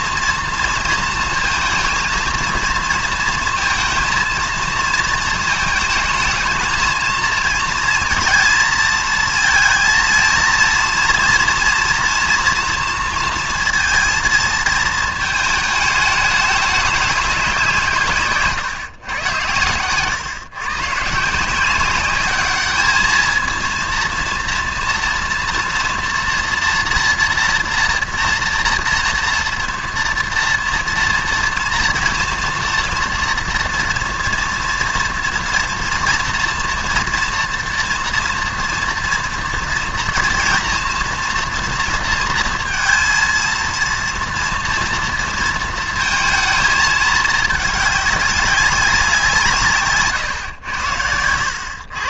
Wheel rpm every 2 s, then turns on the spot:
230, 230, 230, 220, 230, 230, 230, 220, 200, 120, 130, 210, 230, 240, 240, 230, 230, 230, 230, 230, 230, 230, 230, 220, 190, 110.
none